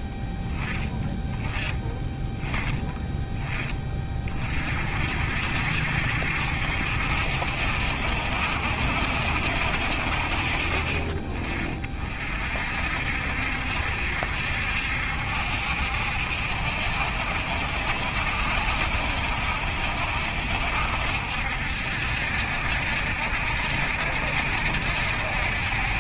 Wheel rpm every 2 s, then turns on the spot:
20, 10, 40, 70, 70, 40, 50, 70, 70, 70, 70, 60, 70.
none